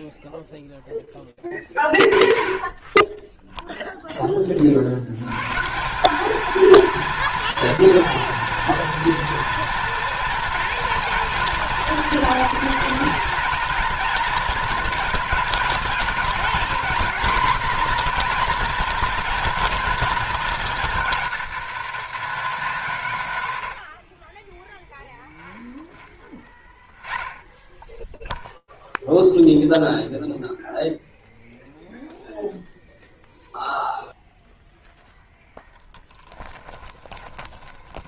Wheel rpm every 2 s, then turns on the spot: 40, 0, 160, 230, 240, 230, 230, 220, 250, 240, 220, 120, 0, 0, 0, 0, 0, 0, 20.
36-38